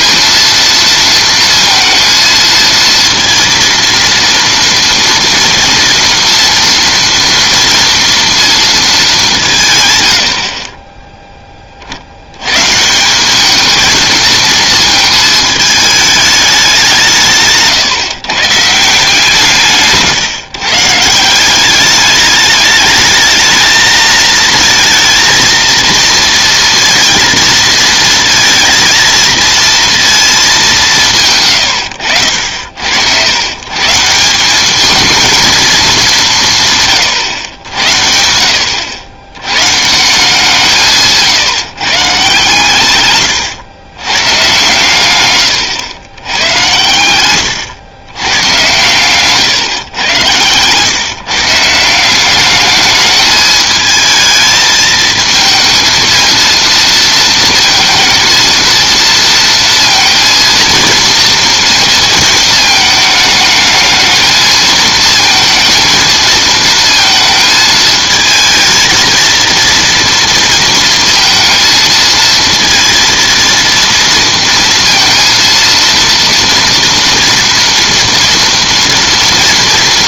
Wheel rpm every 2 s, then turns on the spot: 230, 230, 230, 230, 220, 30, 140, 220, 190, 140, 130, 210, 230, 230, 230, 200, 70, 200, 150, 80, 160, 130, 120, 100, 120, 110, 200, 220, 230, 230, 230, 220, 220, 220, 220, 230, 230, 230, 230, 230.
46-48